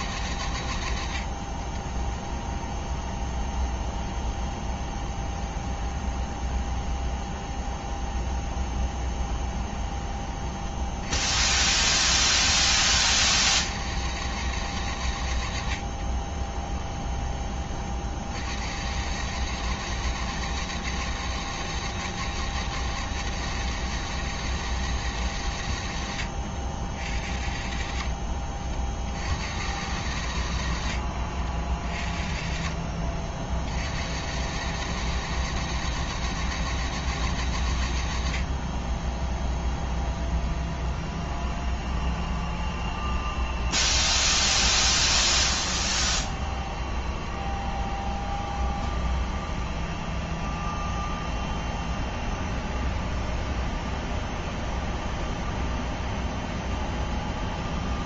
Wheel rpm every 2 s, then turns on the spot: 90, 20, 20, 20, 20, 30, 30, 100, 20, 70, 110, 110, 110, 60, 40, 70, 40, 100, 110, 50, 20, 20, 20, 20, 20, 20, 20, 20, 20.
2-10 16-18 32-34 38-58